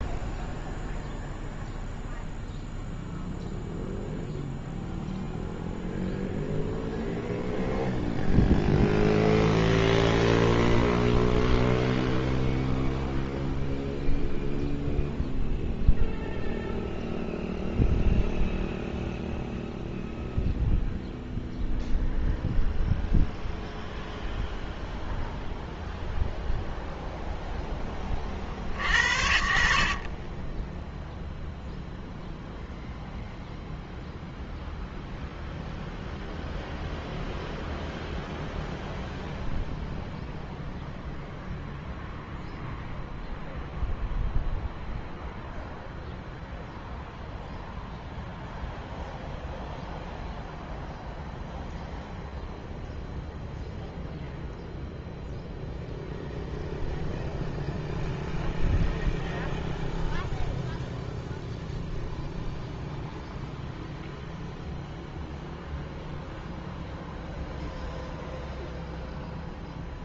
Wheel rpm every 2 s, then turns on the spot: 0, 0, 0, 0, 0, 0, 0, 0, 0, 0, 0, 0, 0, 0, 40, 30, 0, 0, 0, 0, 0, 0, 0, 0, 0, 0, 0, 0, 0, 0, 0, 0, 0, 0, 0.
30-32